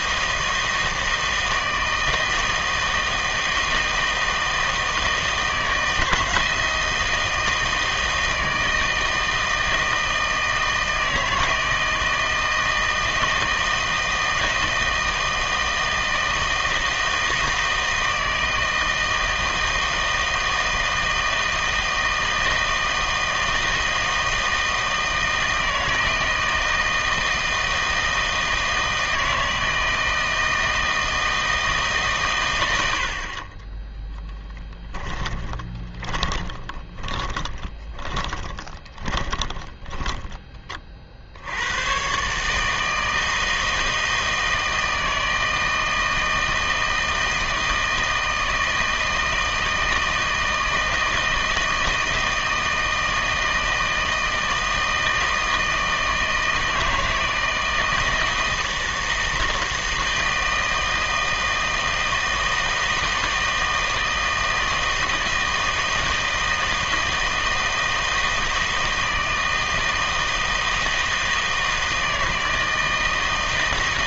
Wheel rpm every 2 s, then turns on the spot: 160, 160, 160, 160, 160, 160, 160, 160, 160, 160, 160, 160, 160, 160, 160, 160, 110, 10, 20, 20, 20, 150, 160, 160, 160, 160, 160, 160, 160, 160, 160, 160, 160, 160, 160, 160, 160.
34-40